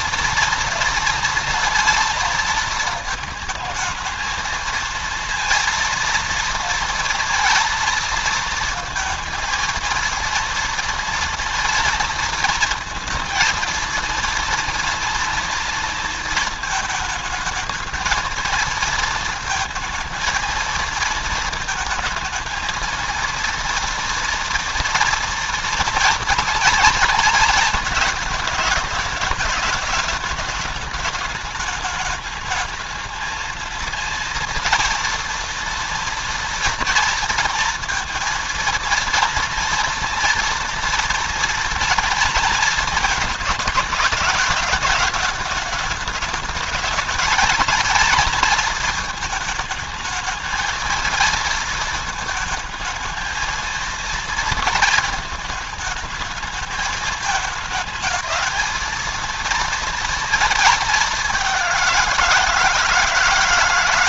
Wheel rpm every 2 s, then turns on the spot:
230, 220, 220, 230, 230, 230, 230, 230, 220, 230, 220, 230, 230, 230, 210, 210, 220, 230, 230, 230, 230, 230, 210, 220, 220, 220, 220, 230, 220, 220, 210, 160.
none